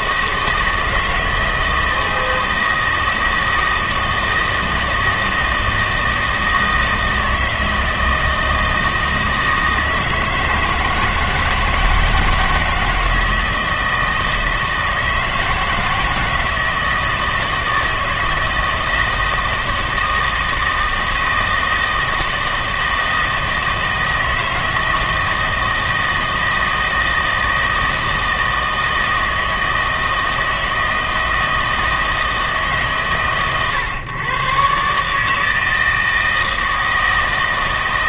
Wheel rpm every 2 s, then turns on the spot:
160, 160, 160, 160, 160, 160, 160, 160, 160, 160, 160, 160, 160, 160, 160, 160, 140, 140, 160.
none